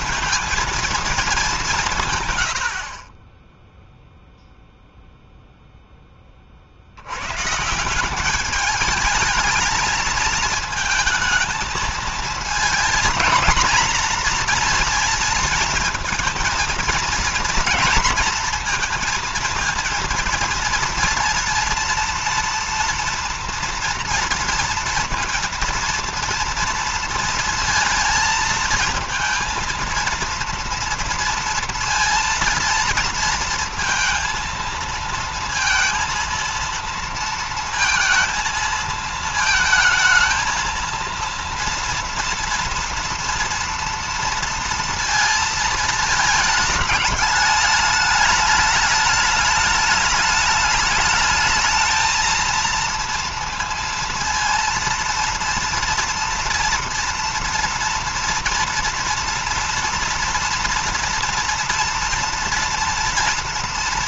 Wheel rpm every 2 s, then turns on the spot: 230, 70, 0, 70, 210, 220, 230, 230, 230, 230, 230, 230, 230, 230, 230, 230, 230, 230, 230, 220, 230, 230, 230, 210, 210, 210, 230, 230, 230, 230, 230, 230.
none